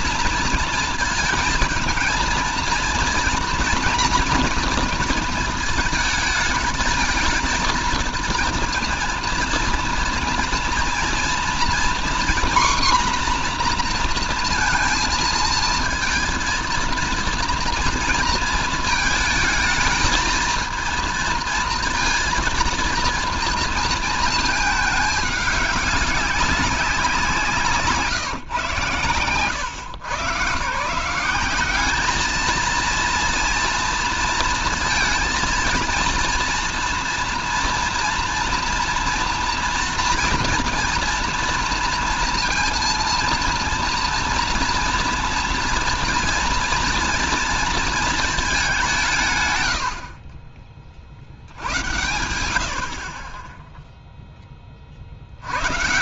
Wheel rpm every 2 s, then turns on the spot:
230, 230, 240, 220, 230, 230, 250, 230, 230, 220, 230, 230, 220, 200, 130, 130, 220, 230, 230, 230, 230, 230, 230, 230, 200, 40, 80, 30.
none